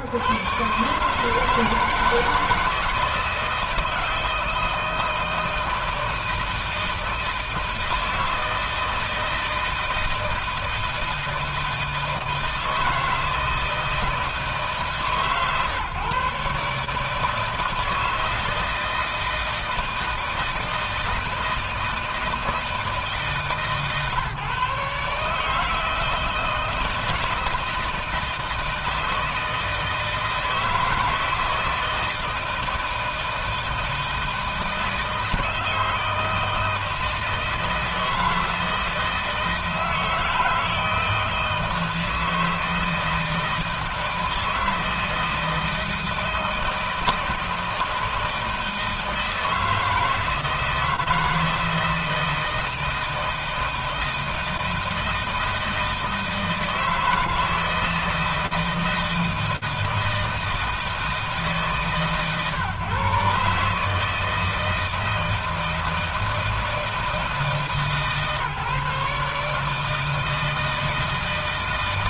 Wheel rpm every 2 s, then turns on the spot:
140, 160, 160, 160, 160, 160, 160, 160, 150, 160, 160, 160, 140, 160, 160, 160, 160, 160, 160, 160, 160, 160, 160, 160, 160, 160, 160, 160, 160, 160, 160, 130, 160, 160, 150, 160.
none